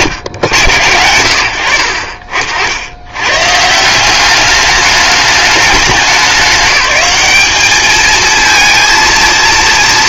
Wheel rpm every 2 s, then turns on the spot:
80, 80, 210, 200, 220.
none